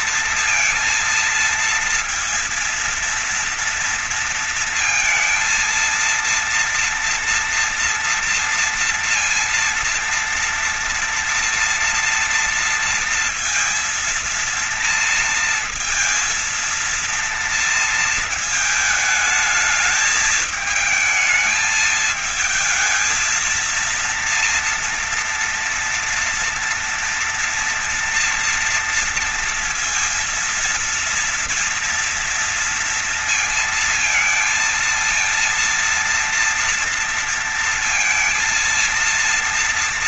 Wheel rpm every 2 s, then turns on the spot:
230, 230, 230, 230, 230, 230, 230, 230, 230, 220, 220, 220, 240, 230, 230, 230, 230, 230, 230, 230.
none